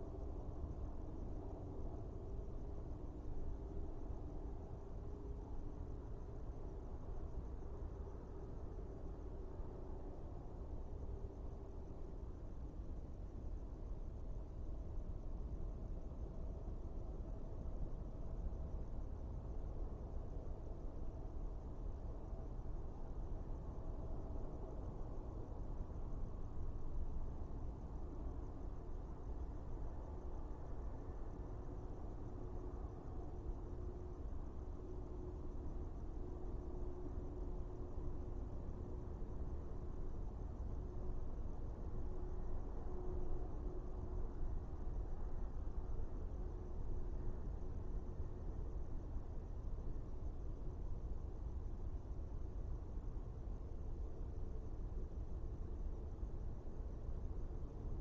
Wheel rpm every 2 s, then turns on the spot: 0, 0, 0, 0, 0, 0, 0, 0, 0, 0, 0, 0, 0, 0, 0, 0, 0, 0, 0, 0, 0, 0, 0, 0, 0, 0, 0, 0, 0.
none